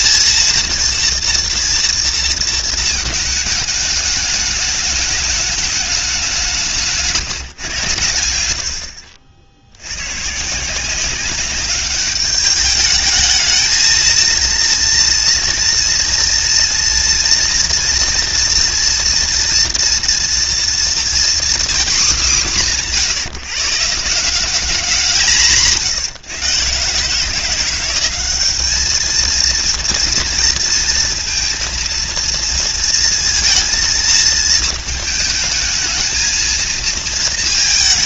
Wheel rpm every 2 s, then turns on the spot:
230, 220, 210, 160, 70, 180, 210, 230, 230, 240, 240, 190, 190, 140, 210, 230, 230, 220, 220.
none